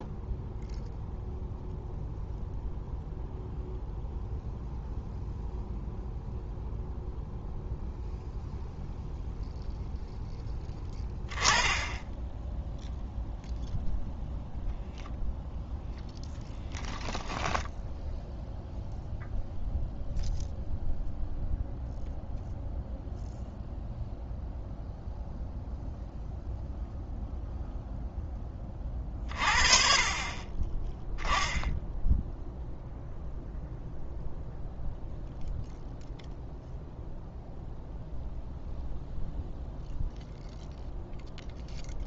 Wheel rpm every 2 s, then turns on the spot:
0, 0, 0, 0, 0, 0, 0, 0, 10, 0, 0, 0, 0, 0, 20, 20, 0, 0, 0, 0, 0.
16-18